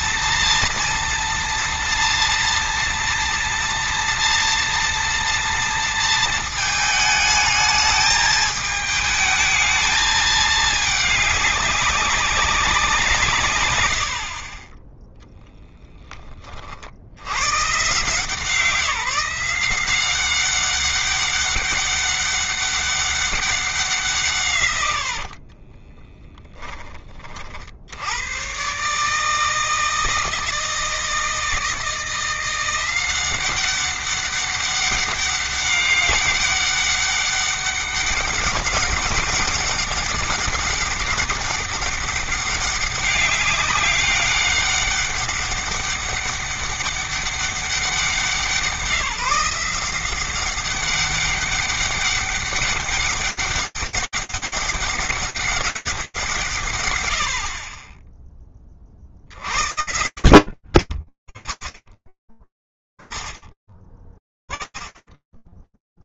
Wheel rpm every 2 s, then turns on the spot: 230, 240, 230, 220, 220, 220, 190, 50, 40, 160, 190, 200, 140, 10, 120, 160, 180, 200, 200, 200, 200, 200, 200, 200, 180, 190, 200, 200, 140, 20, 60, 20, 10.
24-26